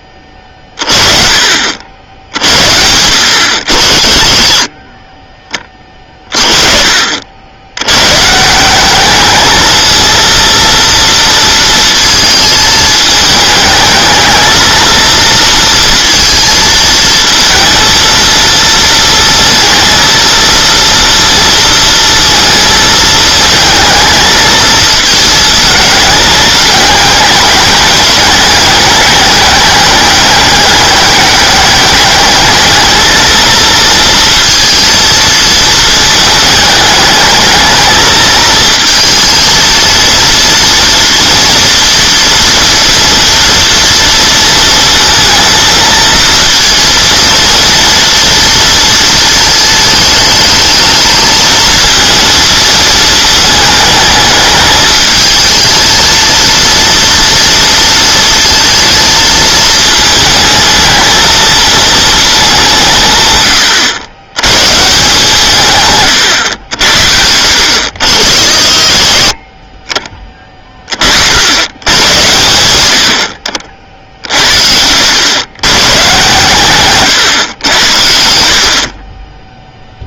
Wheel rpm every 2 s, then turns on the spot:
30, 80, 40, 40, 180, 230, 220, 230, 230, 230, 230, 220, 220, 210, 210, 210, 220, 230, 220, 230, 230, 240, 230, 230, 230, 220, 230, 210, 230, 230, 220, 170, 130, 90, 50, 30, 90, 80, 120, 60.
none